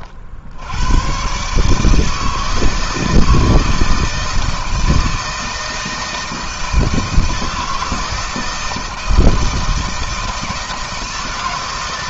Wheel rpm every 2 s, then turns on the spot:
100, 160, 160, 160, 160, 160.
none